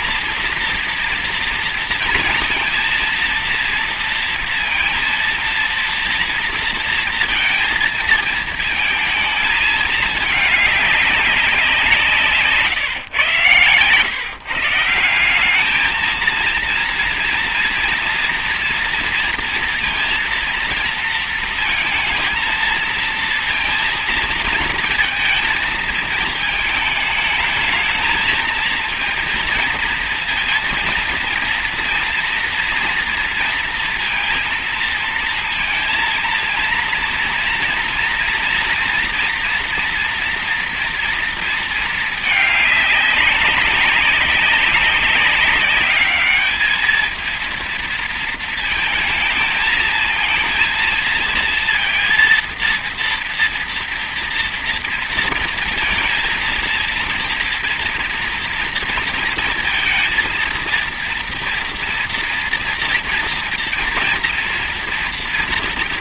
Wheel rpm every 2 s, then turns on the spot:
230, 230, 230, 230, 220, 200, 120, 170, 230, 230, 230, 230, 230, 220, 230, 230, 230, 230, 230, 230, 230, 200, 200, 230, 220, 230, 230, 230, 230, 230, 230, 230, 230.
none